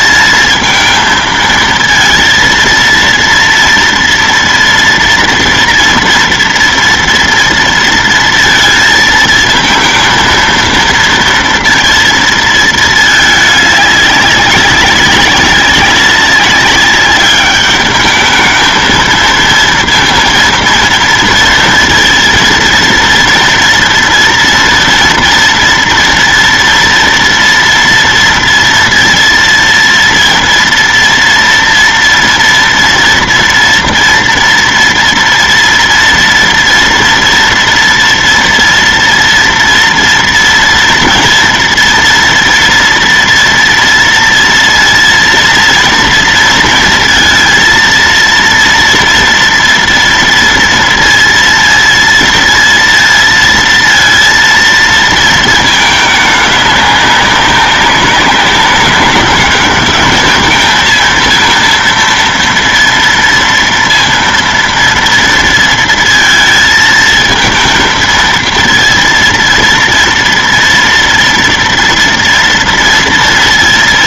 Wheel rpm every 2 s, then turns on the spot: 220, 230, 230, 230, 230, 230, 230, 200, 200, 220, 230, 230, 230, 230, 230, 230, 230, 230, 230, 230, 230, 230, 230, 230, 230, 230, 230, 230, 200, 190, 220, 230, 230, 230, 230, 230, 230.
none